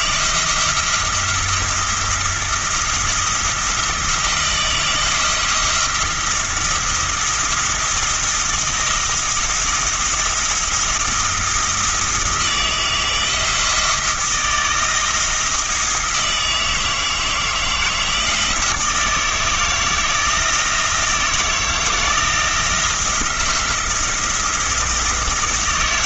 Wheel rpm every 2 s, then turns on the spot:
170, 170, 170, 170, 170, 170, 160, 160, 160, 160, 170, 170, 170.
none